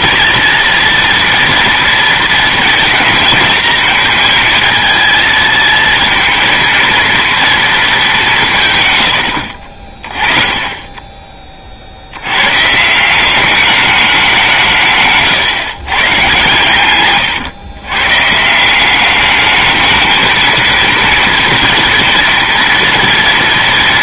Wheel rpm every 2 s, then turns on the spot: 230, 230, 230, 230, 150, 30, 130, 170, 130, 170, 230, 230.
10-12